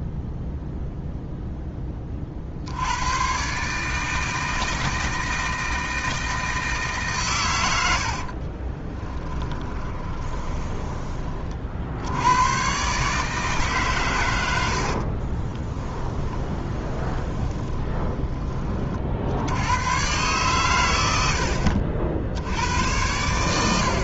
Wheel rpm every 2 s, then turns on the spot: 0, 80, 160, 150, 30, 20, 120, 70, 30, 40, 100, 90.
8-12 14-18